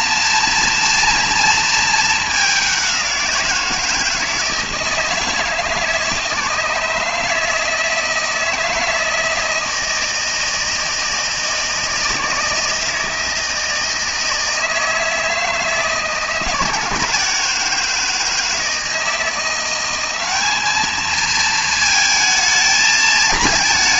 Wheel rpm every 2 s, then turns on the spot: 230, 200, 160, 160, 160, 160, 160, 160, 160, 160, 210, 220.
none